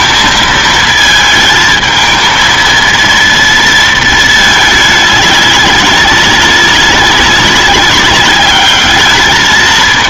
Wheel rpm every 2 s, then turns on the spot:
220, 230, 210, 190, 210.
none